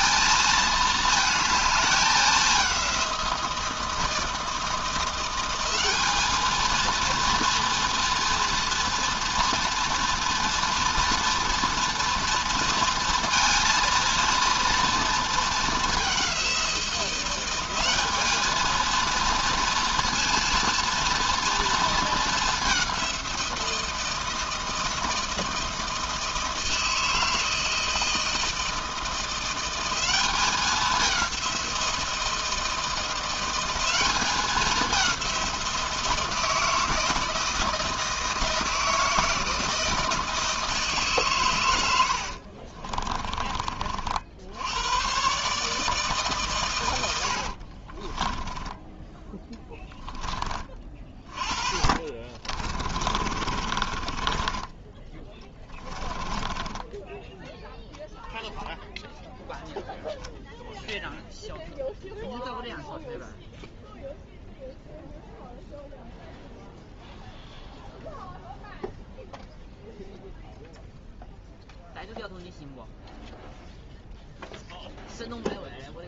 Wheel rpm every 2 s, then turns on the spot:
220, 190, 170, 220, 240, 240, 230, 230, 180, 220, 230, 200, 160, 160, 160, 200, 160, 200, 160, 160, 160, 50, 90, 120, 10, 20, 30, 20, 10, 0, 0, 0, 0, 0, 0, 0, 0, 0.
42-44 52-58